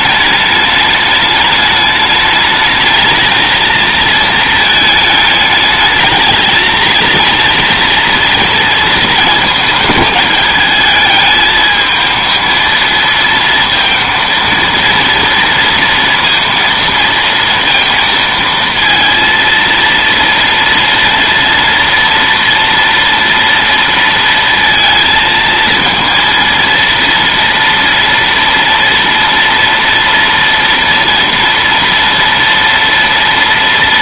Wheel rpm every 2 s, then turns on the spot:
210, 210, 220, 220, 230, 210, 230, 230, 230, 230, 230, 230, 230, 230, 230, 230, 230.
none